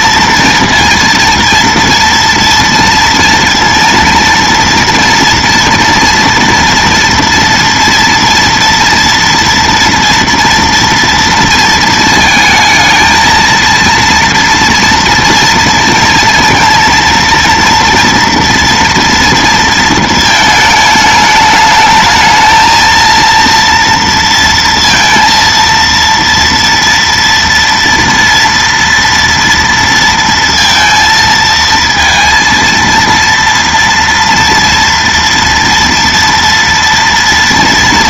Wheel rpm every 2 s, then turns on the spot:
230, 230, 230, 230, 230, 230, 220, 230, 230, 230, 220, 230, 230, 230, 230, 230, 230, 230, 230.
none